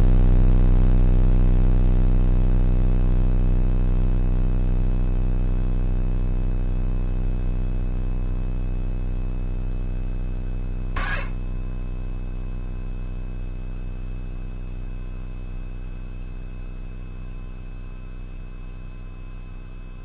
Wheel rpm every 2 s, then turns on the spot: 0, 0, 0, 0, 0, 10, 0, 0, 0, 0.
none